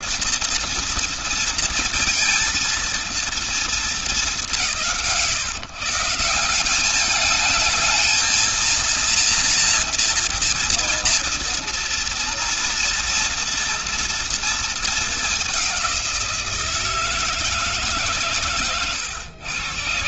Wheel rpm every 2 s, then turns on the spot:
230, 230, 180, 200, 230, 230, 230, 220, 170, 110.
none